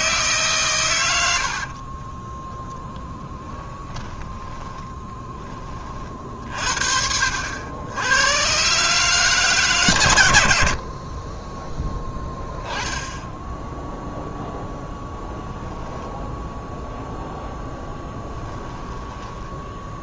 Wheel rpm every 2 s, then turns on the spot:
130, 10, 10, 50, 140, 80, 10, 0, 0, 10.
4-6 18-20